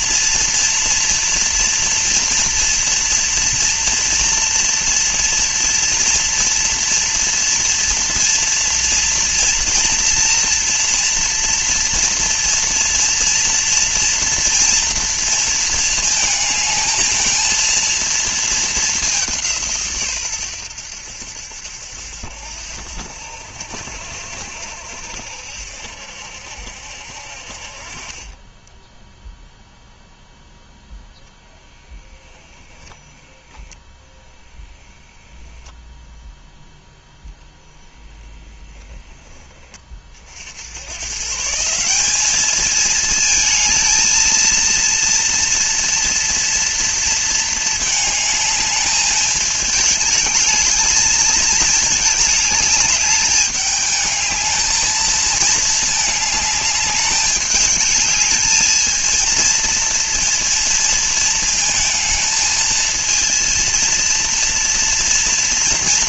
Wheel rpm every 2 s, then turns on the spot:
230, 230, 230, 230, 230, 230, 230, 230, 220, 200, 90, 70, 70, 60, 10, 0, 10, 0, 0, 10, 110, 220, 230, 230, 220, 220, 210, 220, 200, 220, 220, 220, 230.
none